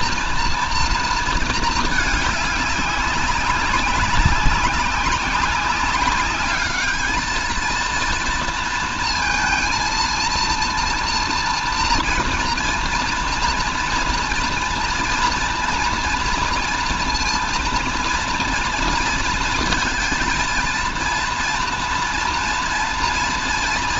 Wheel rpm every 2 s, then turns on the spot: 230, 200, 200, 210, 230, 230, 240, 230, 230, 230, 230, 240.
none